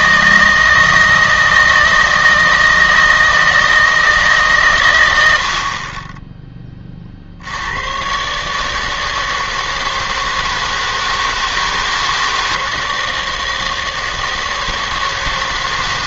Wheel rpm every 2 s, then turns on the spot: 160, 160, 130, 10, 150, 160, 160, 160.
none